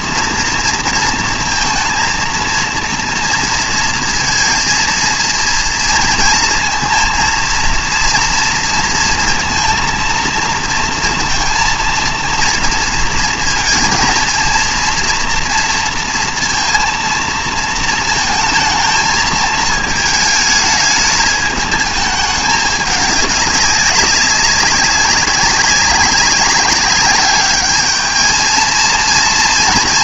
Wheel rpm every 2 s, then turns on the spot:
230, 230, 230, 230, 230, 230, 230, 230, 230, 230, 220, 210, 200, 200, 230.
none